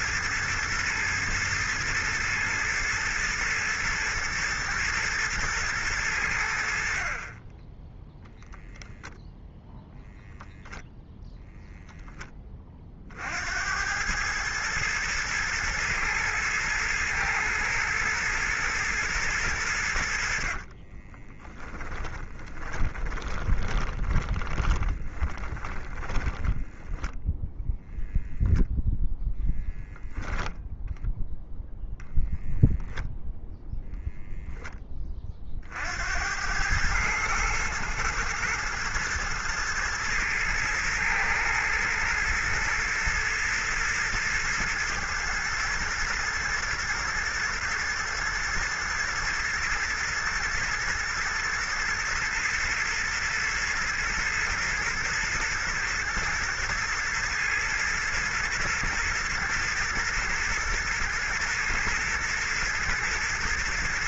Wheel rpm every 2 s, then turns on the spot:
120, 110, 110, 50, 10, 10, 40, 110, 110, 110, 40, 20, 20, 10, 0, 0, 0, 20, 100, 110, 110, 120, 110, 120, 110, 110, 120, 120, 110, 110, 110, 120.
20-26